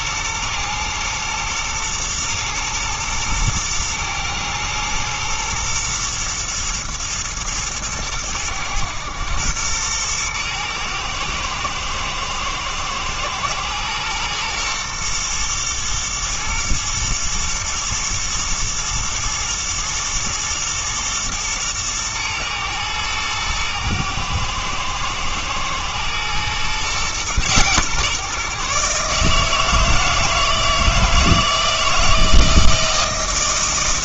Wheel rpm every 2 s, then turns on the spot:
120, 110, 110, 120, 110, 110, 120, 120, 120, 110, 110, 110, 110, 130, 140, 160, 160.
none